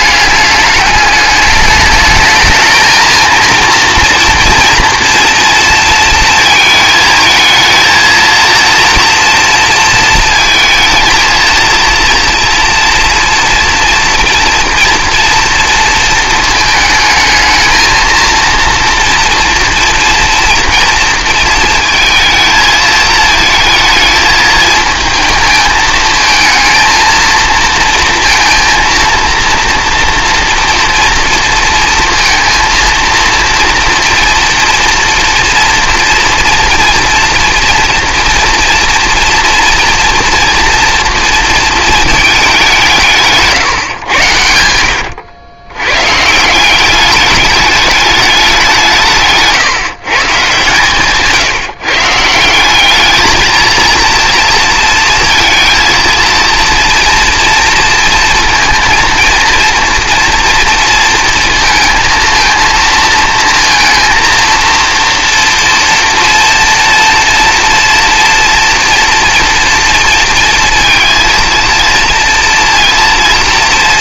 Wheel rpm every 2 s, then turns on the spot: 210, 220, 230, 220, 230, 230, 230, 230, 220, 230, 230, 220, 220, 220, 230, 230, 230, 230, 230, 230, 230, 200, 100, 160, 190, 140, 170, 230, 230, 230, 230, 230, 230, 240, 230, 230, 230.
none